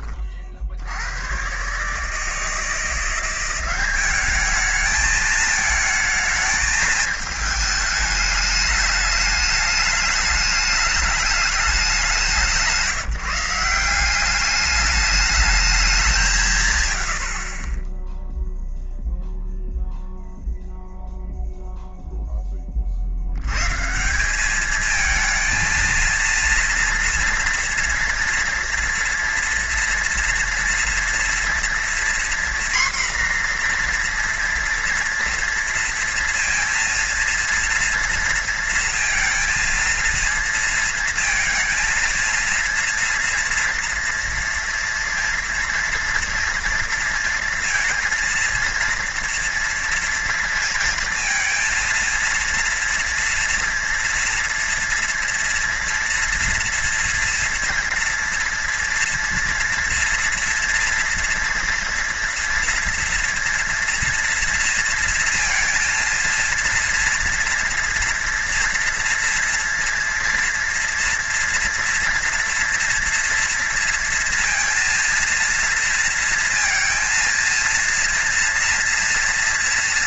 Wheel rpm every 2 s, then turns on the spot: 50, 160, 210, 220, 210, 210, 180, 200, 150, 0, 0, 20, 200, 230, 230, 230, 250, 240, 230, 230, 230, 230, 230, 230, 230, 230, 230, 240, 230, 230, 240, 230, 230, 230, 240, 230, 240, 230, 230, 230.
none